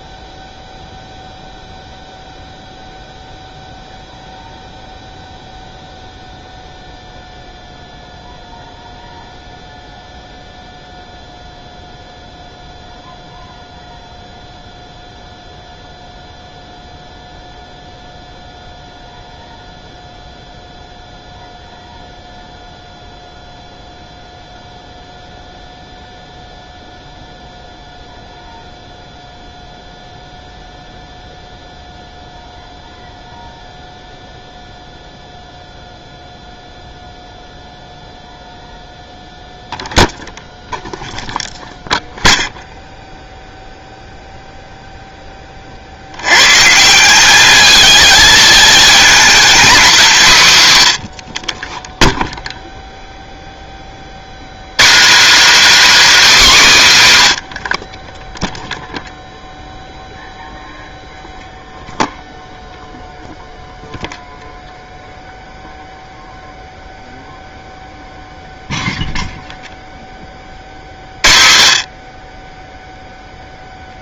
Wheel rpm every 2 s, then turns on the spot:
0, 0, 0, 0, 0, 0, 0, 0, 0, 0, 0, 0, 0, 0, 0, 0, 0, 0, 0, 0, 0, 0, 0, 140, 220, 130, 0, 160, 250, 0, 0, 0, 0, 0, 0, 40, 10.
none